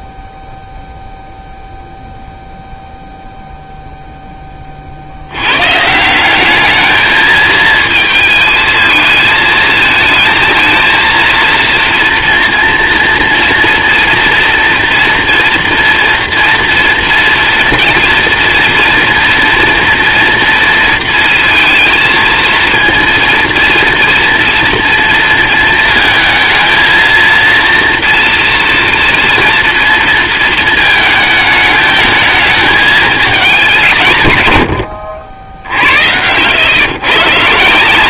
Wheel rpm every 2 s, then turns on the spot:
0, 0, 40, 210, 220, 230, 230, 230, 230, 230, 230, 230, 240, 230, 240, 220, 220, 100, 120.
none